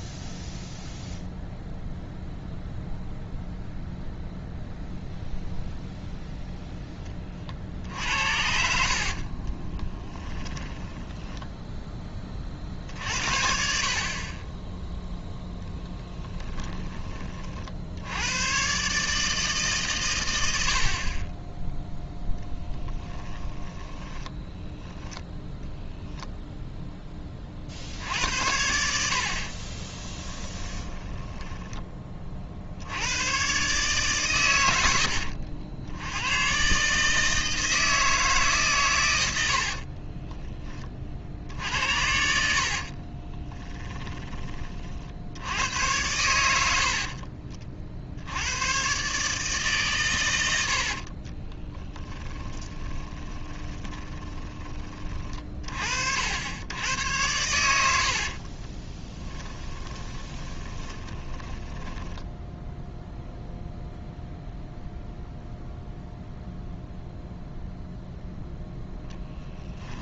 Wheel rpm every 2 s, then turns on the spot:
0, 0, 0, 0, 60, 10, 50, 10, 20, 130, 60, 10, 10, 0, 70, 20, 80, 90, 140, 130, 20, 40, 40, 80, 110, 70, 20, 20, 90, 30, 20, 0, 0, 0, 0.
8-12 30-32 42-44 50-54 58-62